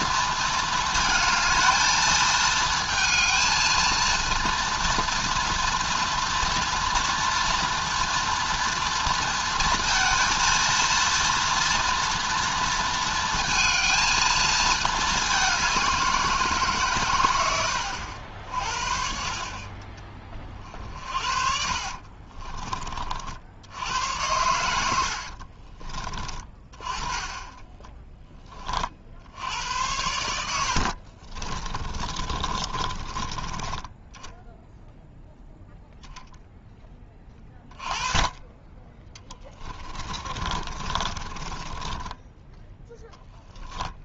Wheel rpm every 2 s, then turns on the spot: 220, 220, 230, 230, 230, 230, 230, 210, 130, 50, 50, 40, 80, 20, 50, 60, 30, 0, 10, 10, 30, 10.
20-22 24-26 30-34 40-42